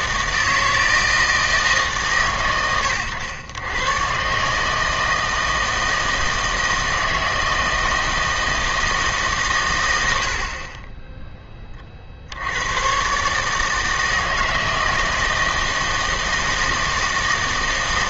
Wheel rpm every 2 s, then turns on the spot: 160, 110, 150, 160, 160, 40, 90, 160, 160.
none